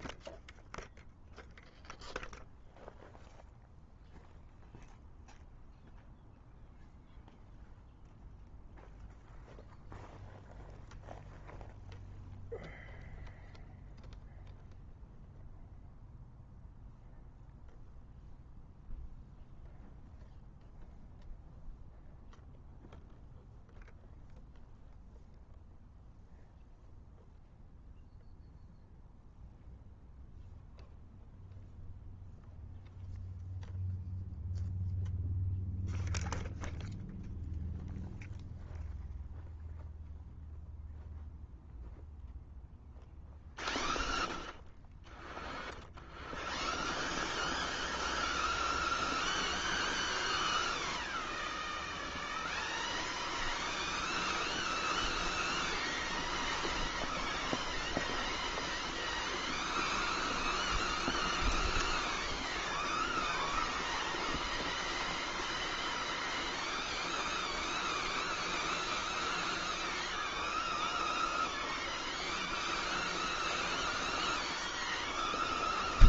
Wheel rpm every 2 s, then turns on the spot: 0, 0, 0, 0, 0, 0, 0, 0, 0, 0, 0, 0, 0, 0, 0, 0, 0, 0, 0, 0, 0, 0, 0, 0, 0, 0, 0, 0, 0, 0, 0, 0, 0, 0, 0, 0, 0, 0.
none